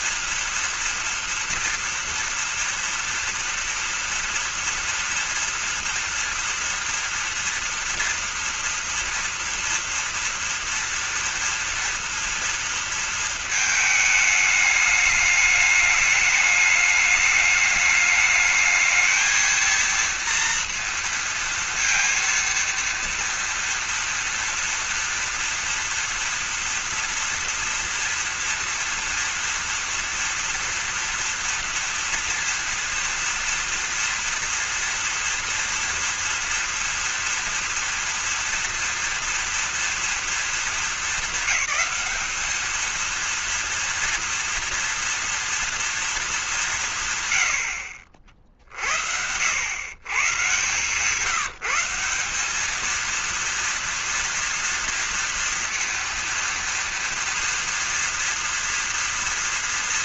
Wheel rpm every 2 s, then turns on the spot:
230, 240, 230, 230, 230, 230, 230, 210, 210, 210, 230, 230, 230, 230, 230, 230, 230, 230, 230, 230, 230, 220, 230, 200, 50, 130, 200, 230, 230, 230.
none